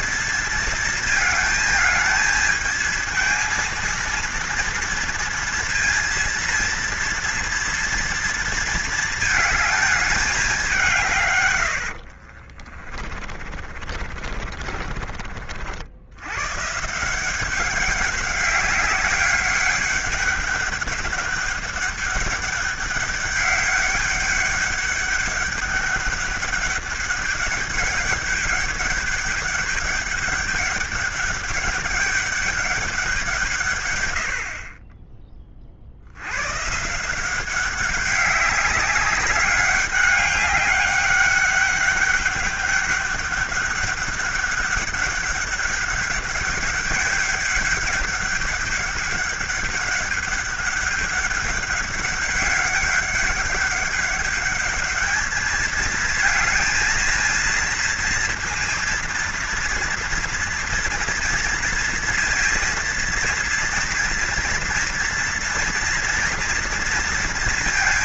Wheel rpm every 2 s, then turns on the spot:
230, 220, 240, 230, 230, 180, 40, 40, 130, 200, 200, 200, 200, 200, 200, 200, 190, 40, 140, 200, 200, 200, 200, 200, 200, 200, 200, 210, 230, 230, 230, 230, 230, 230.
12-16